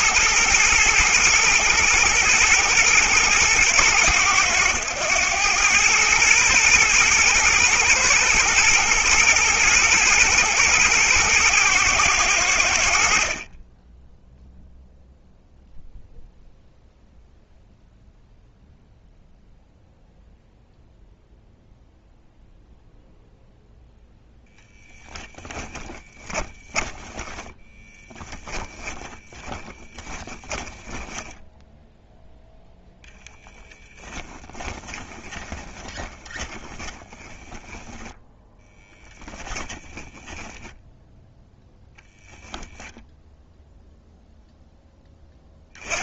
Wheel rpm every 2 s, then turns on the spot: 120, 110, 110, 110, 120, 110, 20, 0, 0, 0, 0, 0, 10, 10, 20, 10, 10, 20, 20, 10, 0, 0, 10.
24-32 34-38